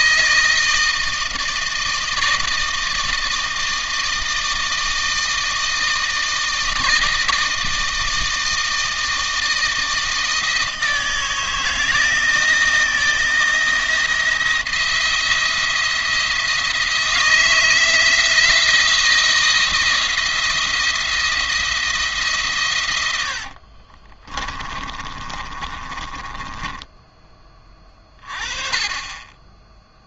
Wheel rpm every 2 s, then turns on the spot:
160, 160, 160, 160, 160, 160, 160, 170, 160, 170, 170, 130, 30, 20, 20.
24-28